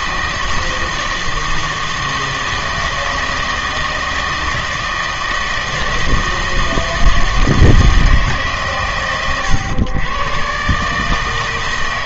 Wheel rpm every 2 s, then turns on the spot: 160, 160, 160, 160, 140, 140.
none